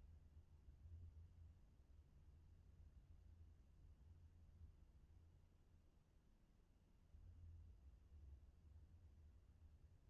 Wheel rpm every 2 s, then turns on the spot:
0, 0, 0, 0, 0.
none